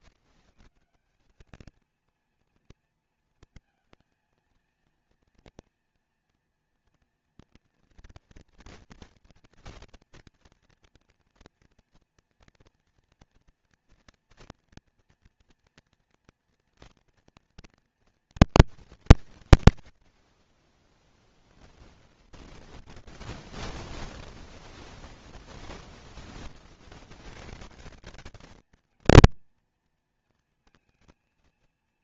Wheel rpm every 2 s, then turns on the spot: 140, 230, 230, 230, 230, 230, 240, 230, 240, 220, 20, 20, 20, 30, 200, 230.
22-26